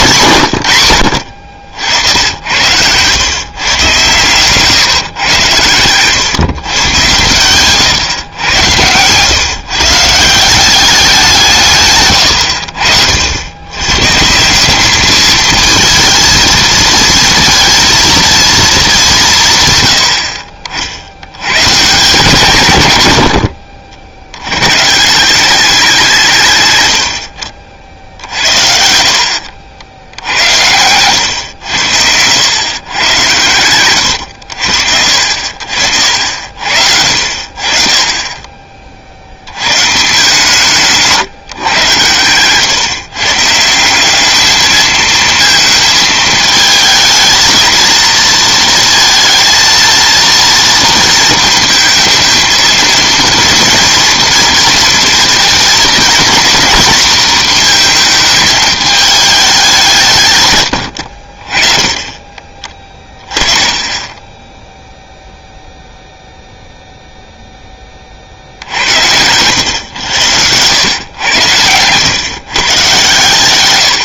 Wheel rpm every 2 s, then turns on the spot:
70, 130, 120, 130, 150, 160, 80, 220, 230, 140, 100, 80, 180, 60, 70, 110, 110, 70, 60, 40, 150, 130, 220, 220, 230, 230, 230, 230, 230, 210, 80, 20, 0, 0, 60, 100, 140.
6-8 68-70